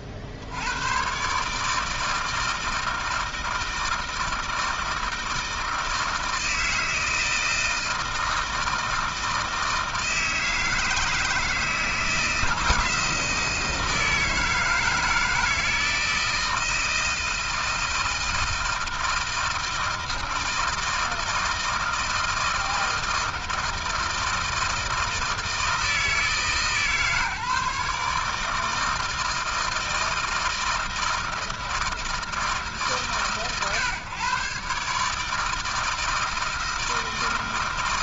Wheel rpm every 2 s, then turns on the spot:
70, 160, 160, 160, 160, 160, 160, 160, 160, 160, 160, 160, 160, 150, 150, 160, 140, 140, 160.
none